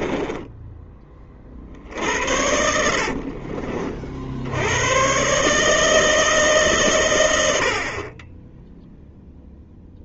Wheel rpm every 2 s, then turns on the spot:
10, 80, 90, 140, 10.
0-4